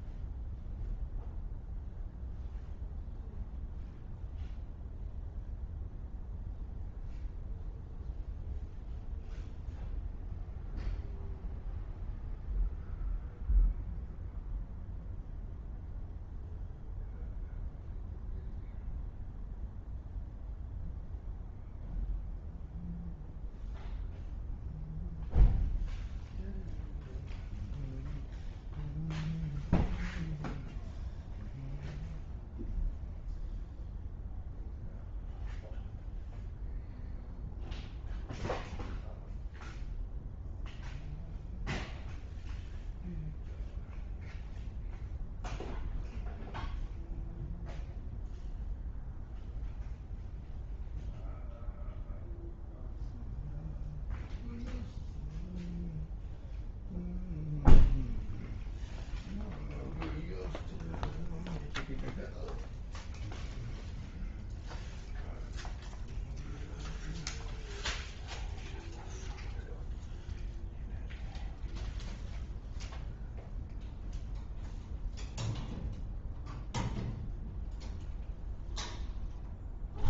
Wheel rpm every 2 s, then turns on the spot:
0, 0, 0, 0, 0, 0, 0, 0, 0, 0, 0, 0, 0, 0, 0, 0, 0, 0, 0, 0, 0, 0, 0, 0, 0, 0, 0, 0, 0, 0, 0, 0, 0, 0, 0, 0, 0, 0, 0, 0.
none